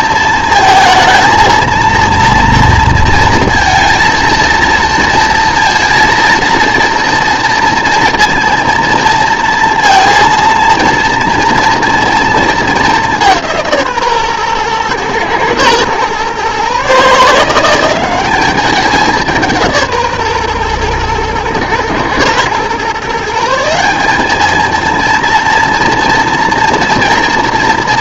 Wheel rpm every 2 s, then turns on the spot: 220, 230, 230, 230, 230, 230, 200, 120, 140, 200, 120, 130, 220, 230.
none